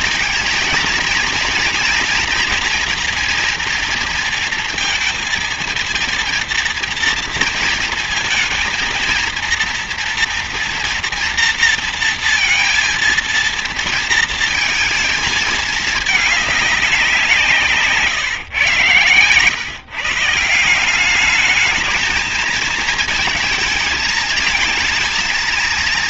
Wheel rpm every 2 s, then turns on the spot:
230, 230, 230, 230, 230, 230, 230, 220, 210, 130, 150, 220, 220.
none